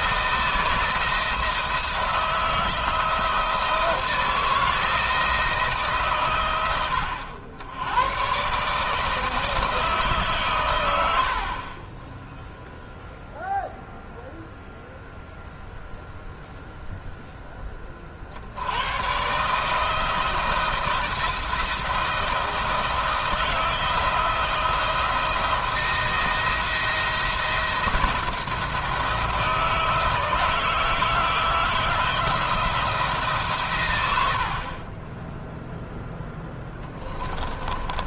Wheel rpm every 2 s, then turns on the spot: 160, 170, 170, 100, 140, 120, 0, 0, 0, 100, 170, 160, 170, 170, 170, 160, 170, 50, 10.
34-36